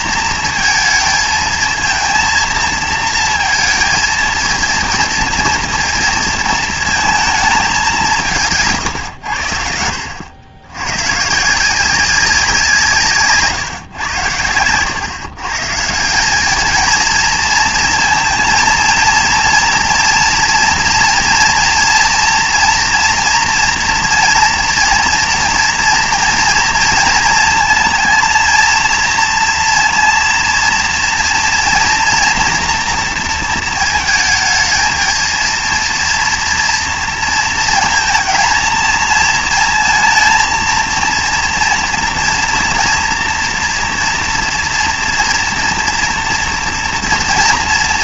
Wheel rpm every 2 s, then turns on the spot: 230, 230, 230, 230, 150, 100, 170, 110, 220, 230, 230, 230, 230, 230, 230, 230, 230, 220, 230, 220, 230, 230, 240, 230.
none